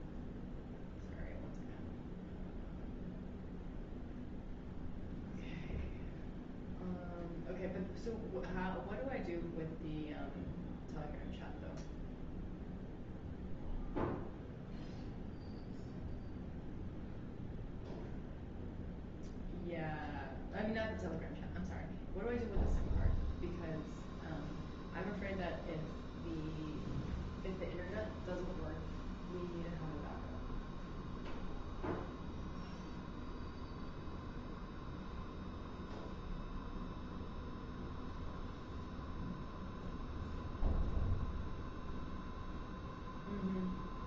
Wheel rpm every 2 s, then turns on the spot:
0, 0, 0, 0, 0, 0, 0, 0, 0, 0, 0, 0, 0, 0, 0, 0, 0, 0, 0, 0, 0, 0.
none